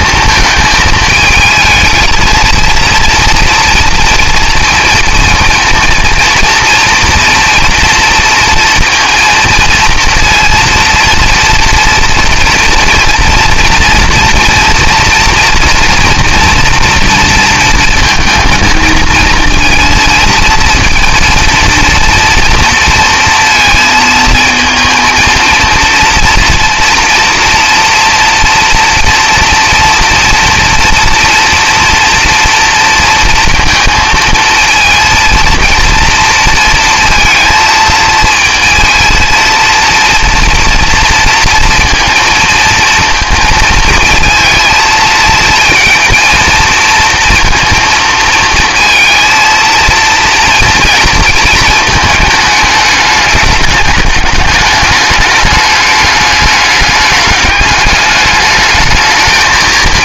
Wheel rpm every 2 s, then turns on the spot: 220, 230, 230, 240, 230, 230, 230, 230, 230, 230, 230, 230, 230, 230, 240, 230, 240, 230, 230, 230, 230, 220, 220, 230, 220, 230, 210, 210, 210, 210.
none